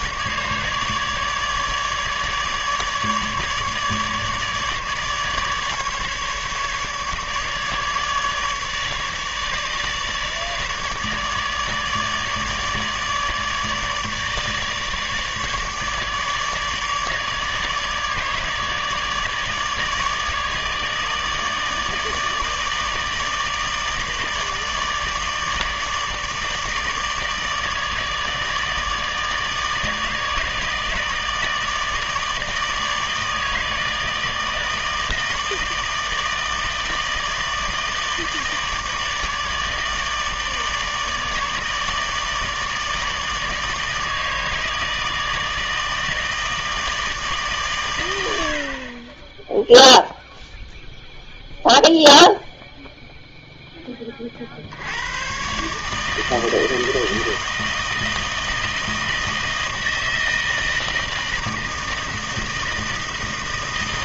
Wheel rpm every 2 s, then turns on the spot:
150, 150, 150, 150, 150, 150, 150, 150, 150, 150, 150, 150, 150, 150, 160, 160, 160, 160, 160, 150, 150, 150, 160, 160, 70, 0, 0, 60, 160, 160, 160, 160.
none